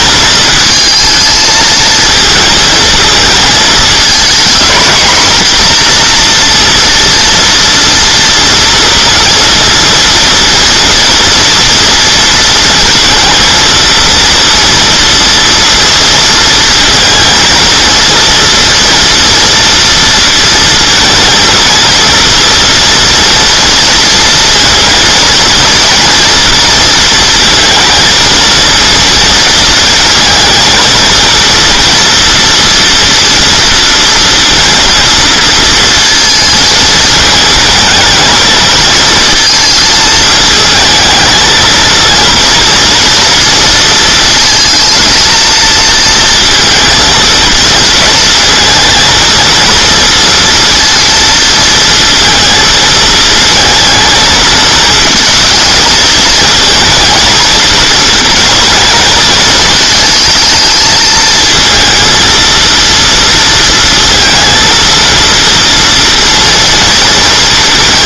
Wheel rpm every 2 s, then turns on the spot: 220, 220, 230, 230, 230, 230, 230, 230, 230, 230, 230, 230, 230, 230, 230, 230, 230, 230, 220, 220, 220, 230, 230, 220, 230, 230, 230, 220, 230, 220, 220, 230, 230, 230.
none